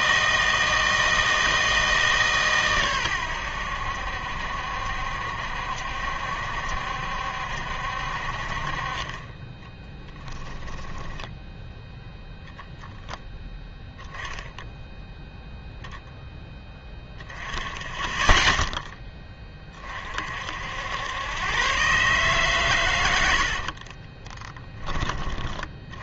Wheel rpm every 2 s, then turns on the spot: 160, 130, 70, 70, 40, 10, 0, 0, 10, 10, 70, 130, 10.
none